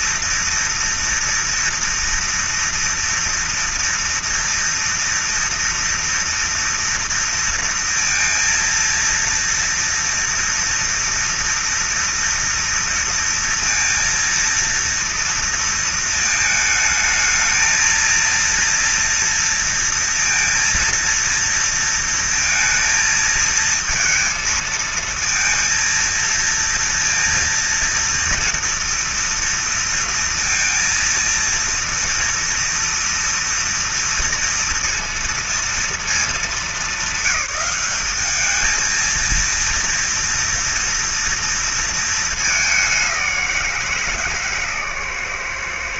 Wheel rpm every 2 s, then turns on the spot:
230, 230, 230, 230, 230, 230, 230, 230, 220, 230, 230, 230, 230, 230, 230, 230, 230, 230, 210, 210, 230, 220, 150.
none